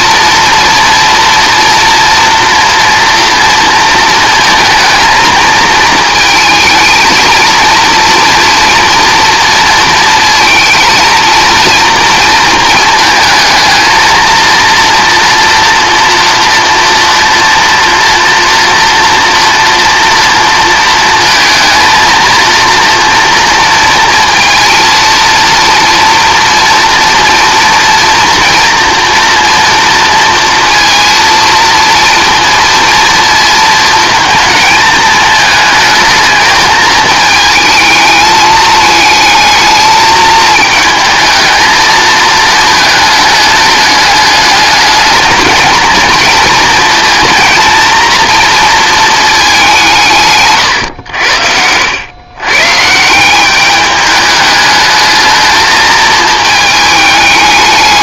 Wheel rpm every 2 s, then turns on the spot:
240, 230, 230, 220, 230, 230, 220, 230, 230, 230, 230, 230, 230, 230, 230, 230, 230, 220, 220, 220, 220, 220, 210, 230, 230, 110, 140, 210, 220.
none